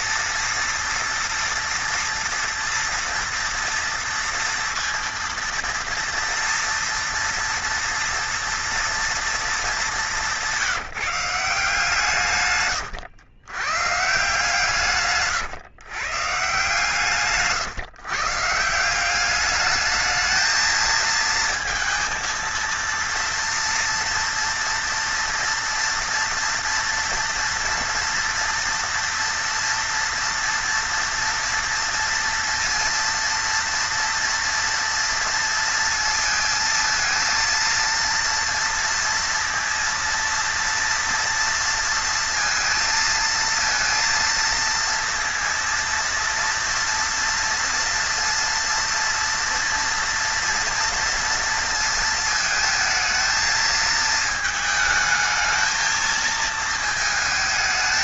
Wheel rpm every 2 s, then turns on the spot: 230, 230, 230, 230, 230, 180, 140, 150, 140, 160, 220, 230, 230, 230, 240, 240, 230, 230, 230, 230, 230, 230, 230, 230, 230, 230, 220, 220, 220.
12-14